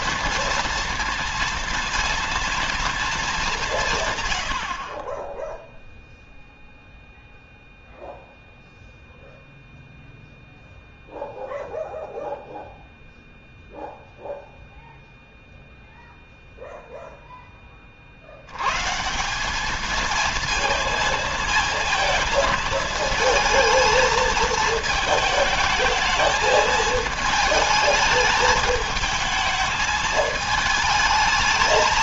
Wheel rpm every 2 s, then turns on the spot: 230, 230, 70, 0, 0, 0, 0, 0, 0, 100, 230, 220, 220, 220, 220, 220.
none